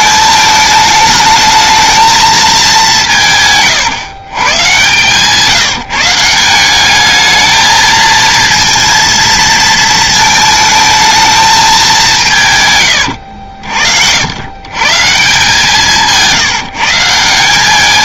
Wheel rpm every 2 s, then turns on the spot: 220, 180, 140, 200, 230, 220, 110, 150, 160.
none